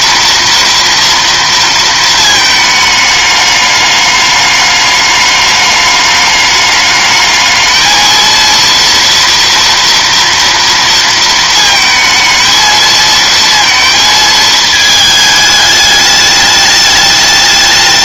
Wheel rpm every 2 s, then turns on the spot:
230, 220, 210, 210, 230, 230, 220, 220, 210.
none